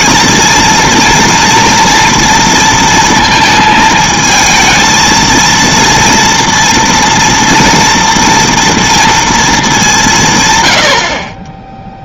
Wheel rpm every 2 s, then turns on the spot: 230, 230, 220, 230, 230, 110.
none